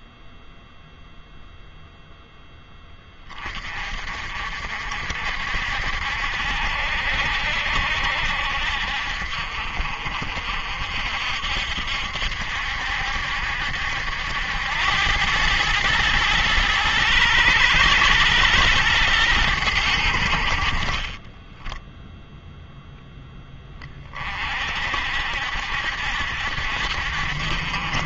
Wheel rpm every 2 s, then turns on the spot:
0, 10, 60, 70, 60, 60, 70, 90, 110, 110, 40, 0, 50, 70.
none